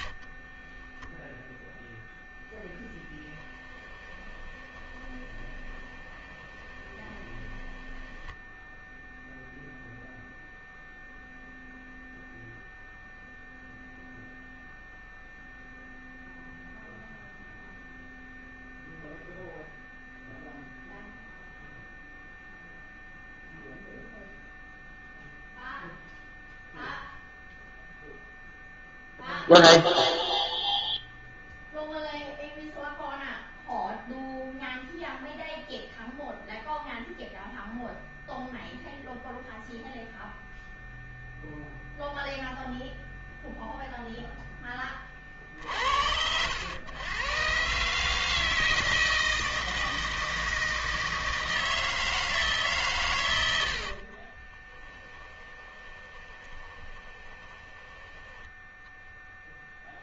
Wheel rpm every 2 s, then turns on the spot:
20, 20, 20, 20, 0, 0, 0, 0, 0, 0, 0, 0, 0, 0, 0, 0, 0, 0, 0, 0, 0, 0, 10, 90, 160, 160, 140, 20, 20, 10.
0-8 54-58